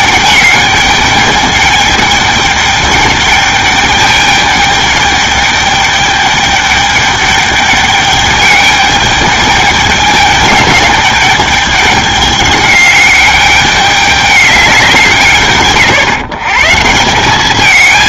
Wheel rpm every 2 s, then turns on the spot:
200, 210, 210, 210, 210, 210, 210, 180, 170.
none